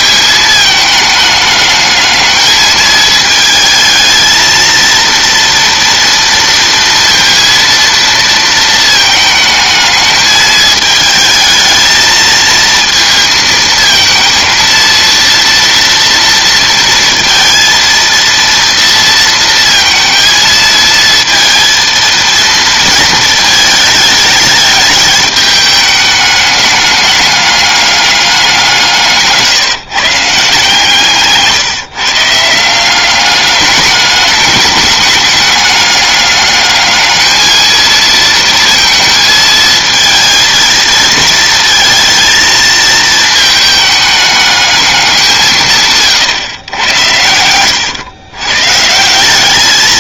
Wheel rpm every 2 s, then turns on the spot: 210, 220, 230, 230, 220, 220, 220, 230, 230, 230, 230, 220, 210, 210, 170, 150, 180, 200, 210, 230, 230, 220, 200, 100, 150.
none